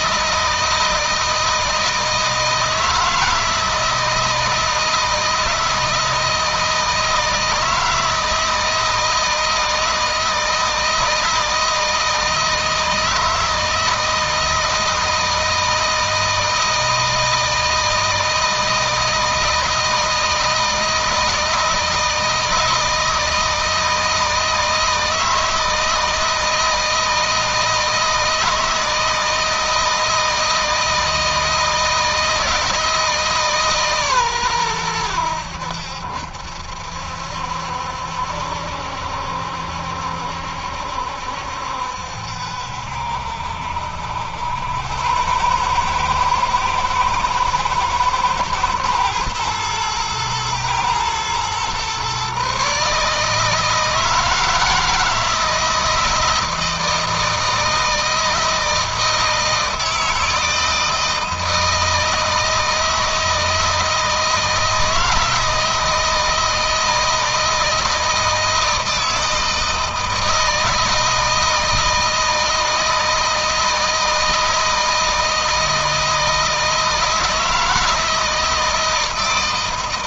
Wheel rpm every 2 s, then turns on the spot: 160, 160, 160, 160, 160, 160, 160, 160, 160, 160, 160, 160, 160, 160, 160, 160, 160, 110, 70, 70, 70, 70, 90, 110, 110, 110, 140, 160, 160, 160, 160, 160, 160, 160, 160, 160, 160, 160, 160, 160.
none